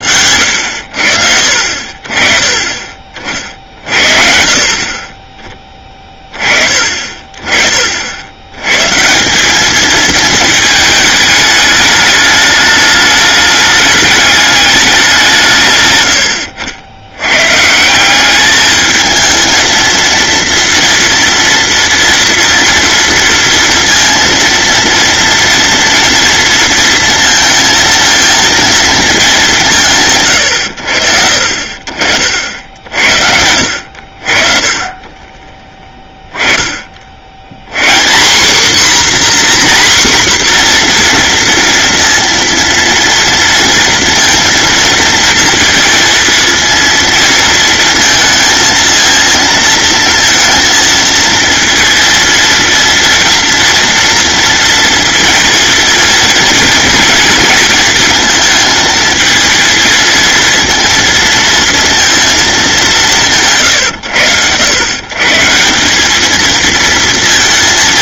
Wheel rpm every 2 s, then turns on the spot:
80, 40, 50, 30, 140, 210, 210, 200, 90, 220, 230, 230, 230, 230, 220, 80, 70, 30, 40, 260, 250, 230, 230, 230, 230, 230, 230, 230, 230, 220, 230, 210, 110, 230.
none